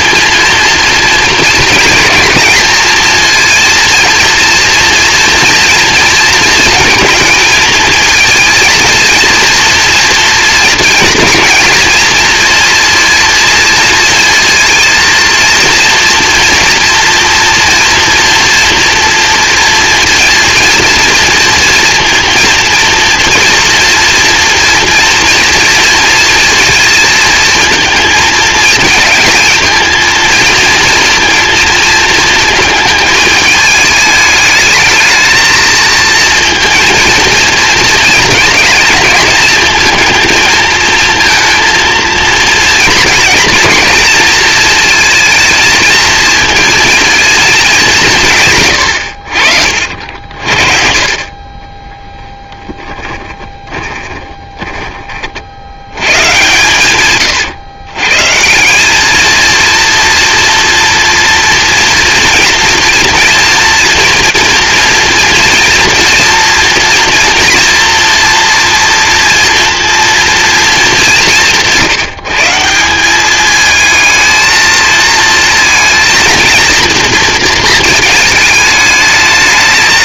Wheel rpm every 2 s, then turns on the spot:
240, 230, 240, 230, 220, 230, 230, 230, 230, 240, 230, 230, 230, 230, 230, 230, 220, 210, 230, 220, 230, 220, 220, 220, 160, 60, 20, 20, 120, 160, 240, 230, 230, 230, 230, 230, 170, 230, 230, 220.
48-56